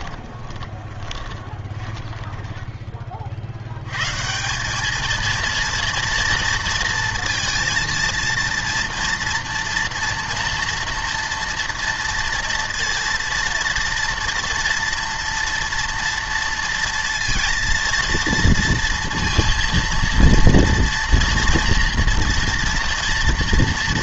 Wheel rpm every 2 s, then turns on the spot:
20, 20, 200, 230, 230, 230, 230, 230, 230, 230, 230, 230.
0-2